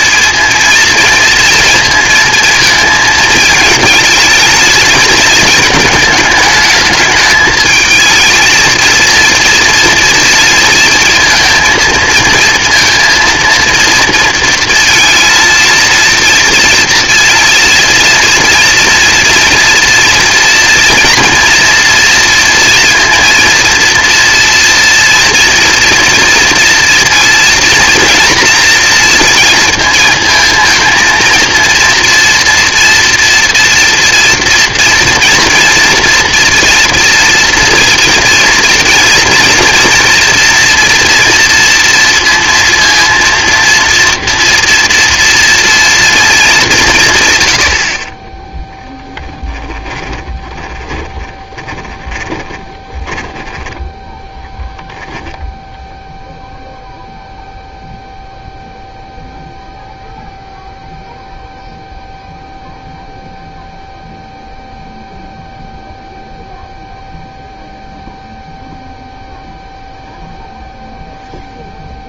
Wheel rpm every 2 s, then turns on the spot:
220, 220, 220, 220, 220, 230, 230, 230, 230, 230, 230, 230, 230, 230, 230, 220, 230, 230, 230, 230, 240, 230, 230, 200, 10, 10, 20, 0, 0, 0, 0, 0, 0, 0, 0, 0.
48-54